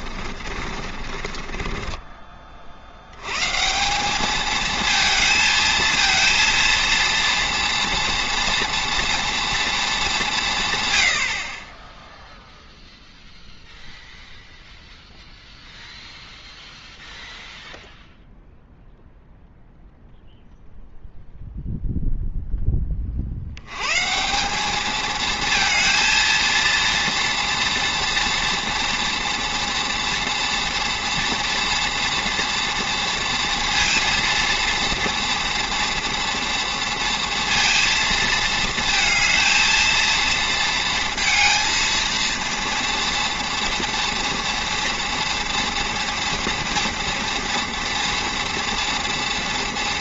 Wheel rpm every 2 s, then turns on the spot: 50, 50, 220, 230, 230, 140, 0, 0, 0, 0, 0, 10, 200, 230, 230, 230, 230, 230, 230, 220, 230, 230, 230, 230, 230.
0-2